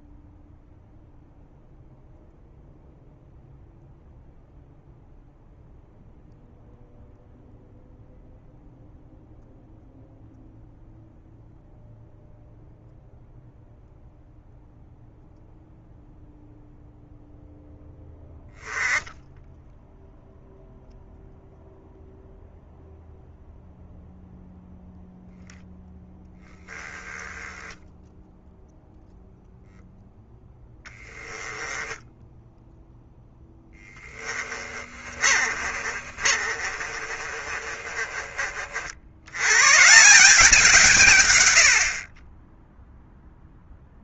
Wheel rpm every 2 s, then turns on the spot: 0, 0, 0, 0, 0, 0, 0, 0, 0, 10, 0, 0, 0, 10, 0, 10, 0, 30, 40, 50, 160, 0.
30-32 34-38